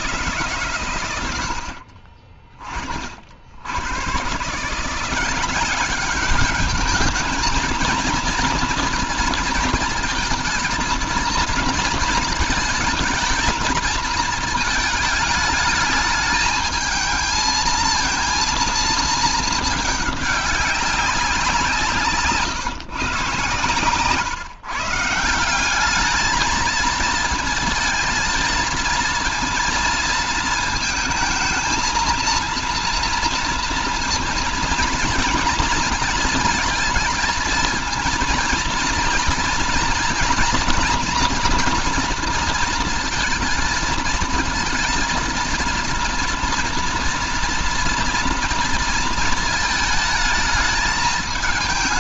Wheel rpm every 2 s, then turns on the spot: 130, 60, 160, 210, 230, 230, 220, 220, 220, 230, 200, 140, 150, 220, 230, 230, 230, 230, 230, 230, 230, 230, 230, 230, 230, 220.
none